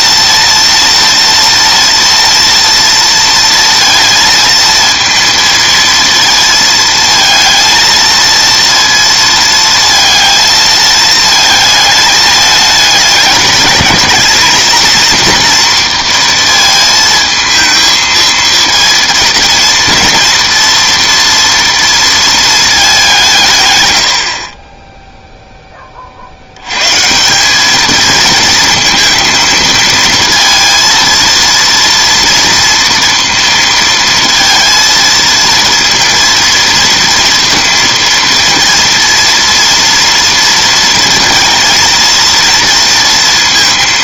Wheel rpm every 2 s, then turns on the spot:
230, 230, 230, 230, 230, 220, 210, 220, 230, 230, 230, 220, 40, 100, 220, 230, 230, 230, 230, 230, 230, 230.
none